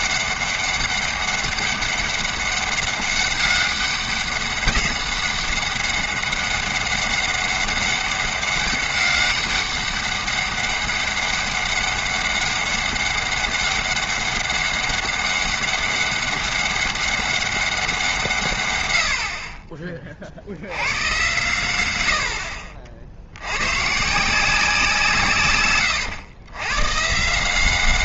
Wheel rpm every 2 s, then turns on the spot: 200, 200, 190, 200, 200, 200, 200, 200, 190, 120, 90, 60, 170, 110.
none